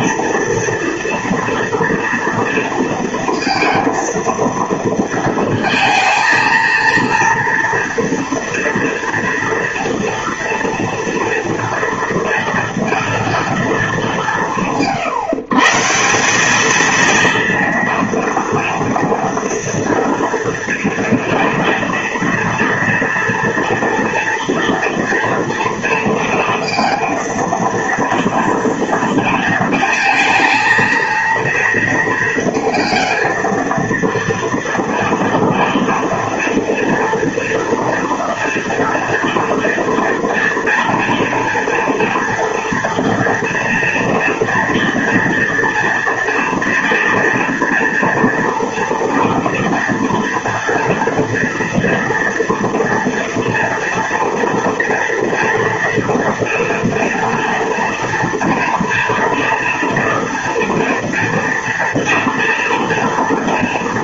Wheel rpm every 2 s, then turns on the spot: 230, 230, 230, 230, 230, 230, 230, 170, 220, 230, 230, 230, 230, 230, 230, 230, 220, 230, 230, 230, 230, 230, 230, 230, 230, 230, 230, 230, 230, 230, 230, 230.
none